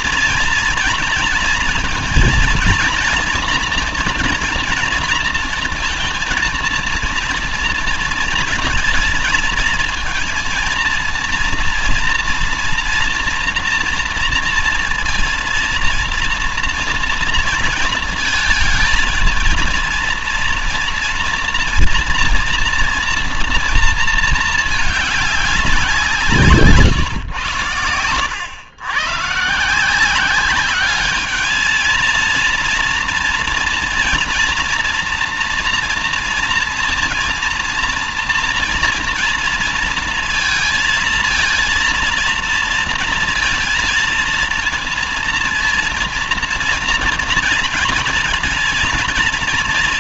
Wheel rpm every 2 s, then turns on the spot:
230, 230, 240, 230, 220, 230, 230, 230, 230, 220, 230, 240, 210, 130, 120, 210, 230, 230, 230, 230, 230, 230, 230, 230, 230.
none